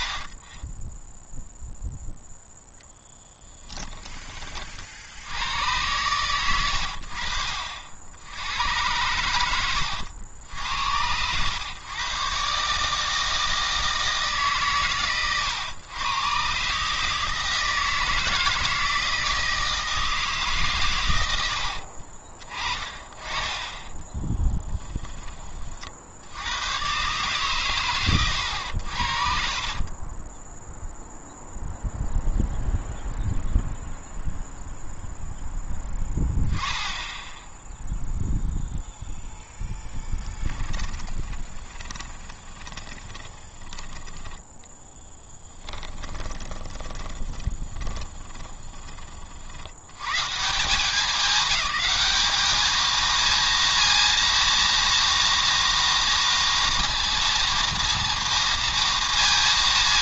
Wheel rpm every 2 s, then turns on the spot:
10, 0, 60, 100, 100, 80, 140, 150, 140, 160, 130, 30, 10, 110, 70, 0, 0, 0, 10, 0, 10, 20, 10, 20, 20, 190, 220, 230, 230, 230.
22-26 40-44 46-48